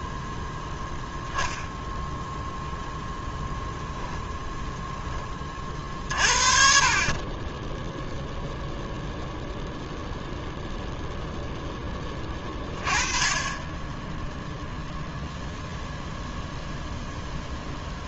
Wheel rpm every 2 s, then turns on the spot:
0, 0, 10, 30, 0, 0, 40, 0, 0.
none